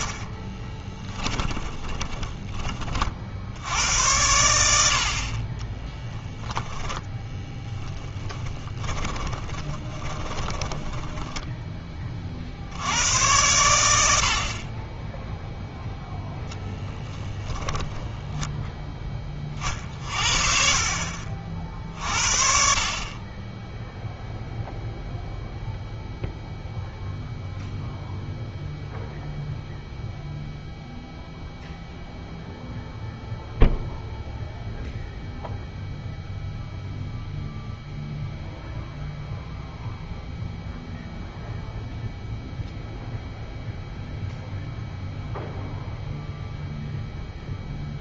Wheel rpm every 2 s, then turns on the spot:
20, 40, 80, 20, 30, 20, 70, 20, 10, 0, 50, 50, 0, 0, 0, 0, 0, 0, 0, 0, 0, 0, 0, 0.
0-2 6-12